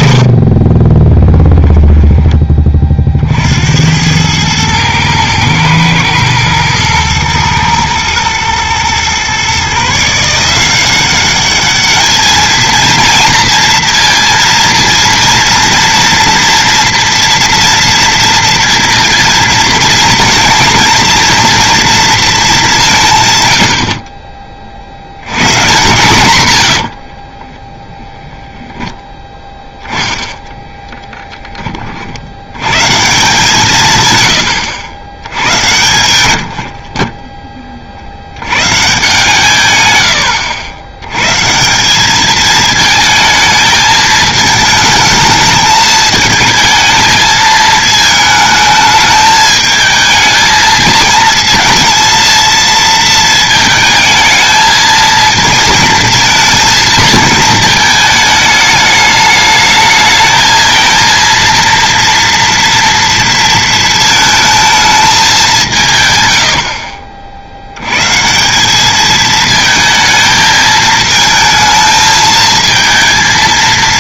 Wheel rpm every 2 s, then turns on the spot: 30, 20, 110, 110, 110, 170, 220, 230, 230, 230, 230, 210, 40, 100, 0, 10, 90, 120, 70, 110, 80, 220, 220, 220, 210, 220, 230, 220, 230, 210, 220, 230, 220, 70, 180, 220, 220.
0-2 26-28 30-32 36-38 66-68